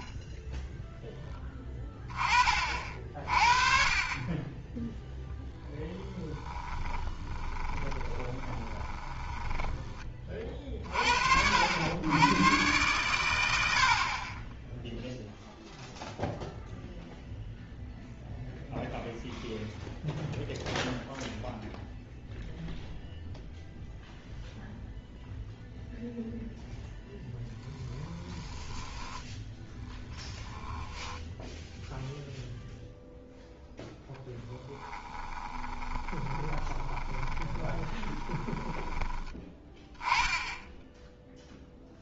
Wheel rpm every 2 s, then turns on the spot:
10, 40, 10, 10, 20, 40, 120, 0, 0, 0, 0, 0, 0, 0, 10, 10, 0, 10, 20, 20, 0.
6-10 30-32 34-40